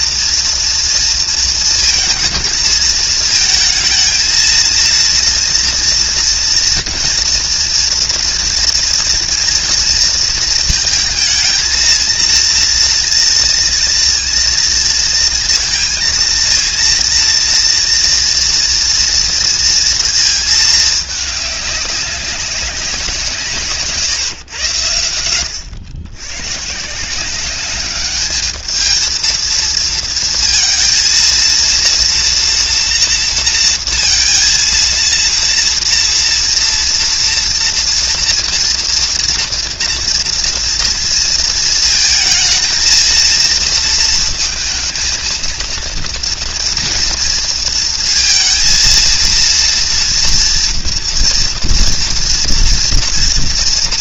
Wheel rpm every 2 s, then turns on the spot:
230, 220, 230, 230, 230, 230, 230, 230, 230, 230, 220, 190, 110, 130, 210, 230, 240, 230, 230, 230, 230, 220, 220, 230, 230, 230, 230.
none